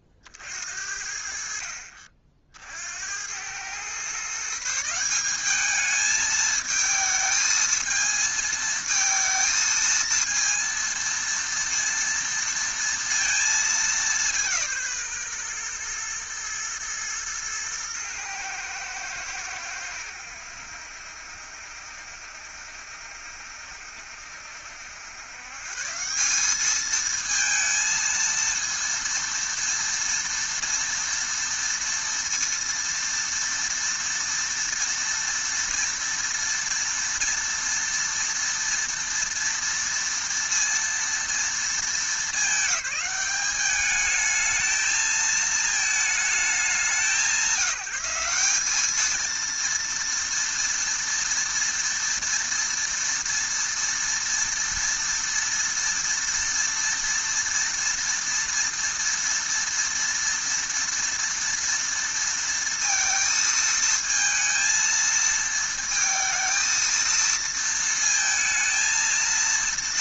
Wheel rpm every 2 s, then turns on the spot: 50, 160, 220, 220, 230, 230, 160, 110, 110, 70, 70, 70, 180, 230, 230, 230, 230, 230, 230, 230, 220, 210, 220, 190, 230, 230, 230, 230, 230, 230, 230, 230, 220, 230, 230.
none